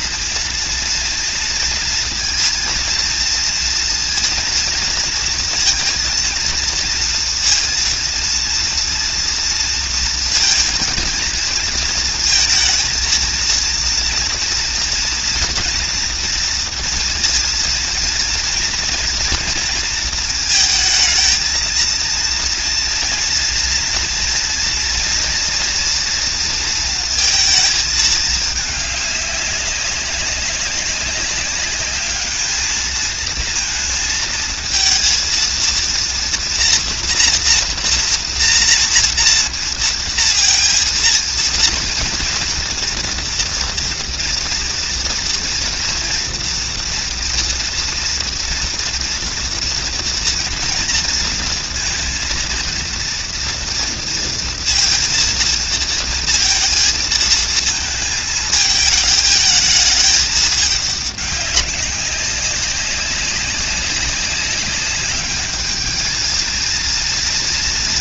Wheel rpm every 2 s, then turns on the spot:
230, 220, 230, 230, 230, 230, 230, 230, 230, 240, 220, 230, 230, 230, 210, 200, 220, 220, 230, 230, 230, 240, 230, 230, 230, 230, 230, 230, 230, 220, 210, 200, 200, 230.
none